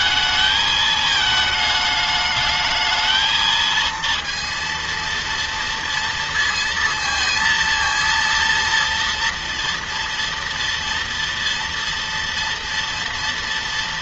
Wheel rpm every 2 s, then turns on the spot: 220, 220, 230, 230, 230, 240, 230.
none